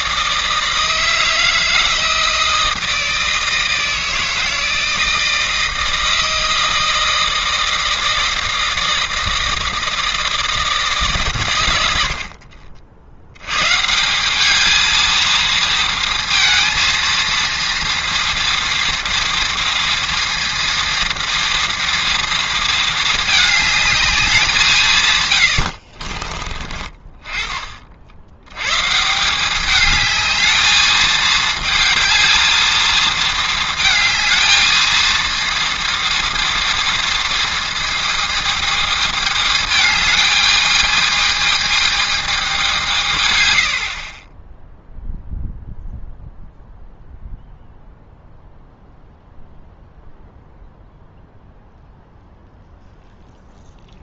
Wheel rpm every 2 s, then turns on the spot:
160, 160, 160, 160, 160, 150, 50, 220, 230, 230, 230, 220, 160, 30, 130, 220, 220, 220, 230, 220, 210, 180, 0, 0, 0, 0, 0.
none